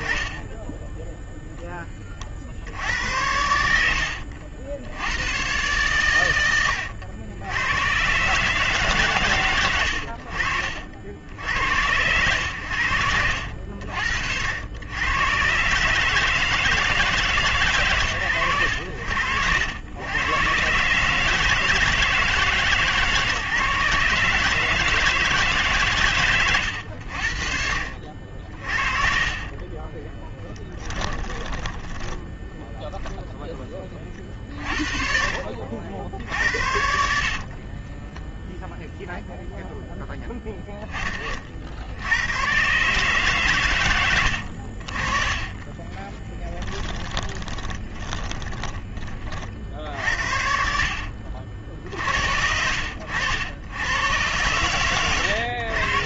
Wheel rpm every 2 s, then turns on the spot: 10, 80, 110, 90, 120, 70, 70, 120, 140, 70, 150, 150, 150, 60, 40, 10, 10, 50, 30, 0, 70, 110, 30, 20, 50, 60, 80, 70.
12-14 26-32 36-38 44-48